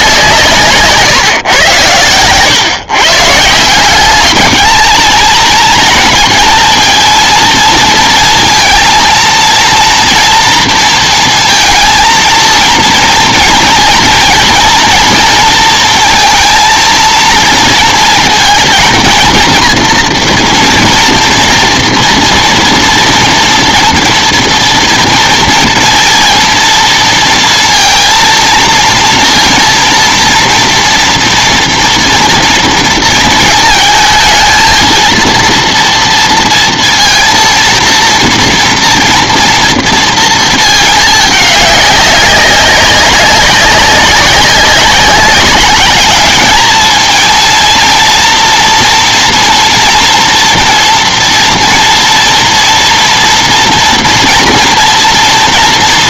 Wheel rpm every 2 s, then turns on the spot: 140, 140, 210, 230, 230, 230, 230, 230, 230, 230, 230, 230, 240, 230, 230, 240, 230, 220, 230, 230, 220, 200, 190, 210, 230, 230, 230, 240.
0-2